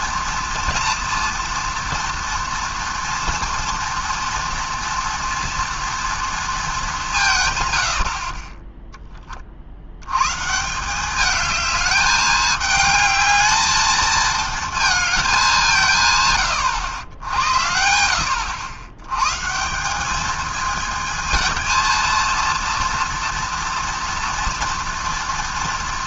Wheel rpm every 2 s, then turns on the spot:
230, 230, 230, 210, 10, 170, 210, 230, 100, 90, 220, 230, 230.
none